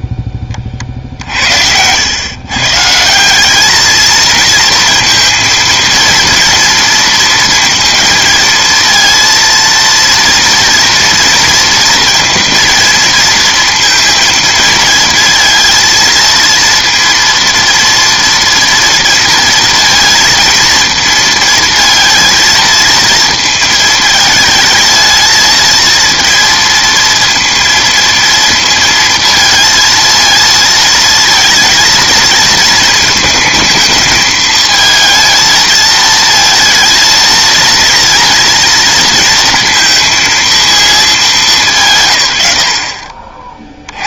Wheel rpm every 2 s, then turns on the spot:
30, 140, 230, 230, 220, 230, 230, 230, 230, 230, 230, 230, 220, 230, 230, 230, 220, 220, 230, 230, 230, 80.
none